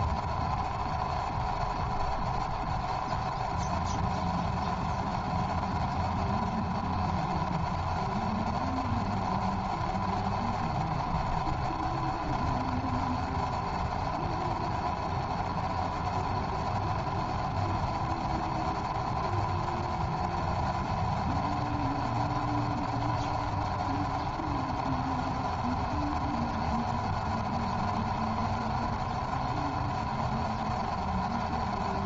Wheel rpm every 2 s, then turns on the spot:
0, 0, 0, 0, 0, 0, 0, 0, 0, 0, 0, 0, 0, 0, 0, 0.
none